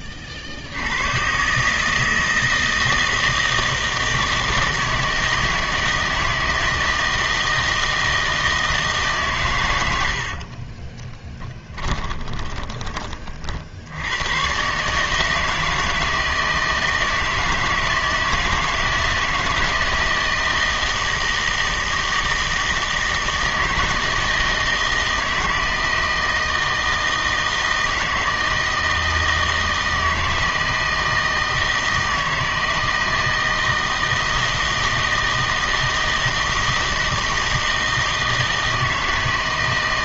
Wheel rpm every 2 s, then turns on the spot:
70, 160, 160, 160, 160, 40, 40, 140, 160, 160, 160, 160, 160, 160, 160, 170, 160, 160, 160, 160.
10-14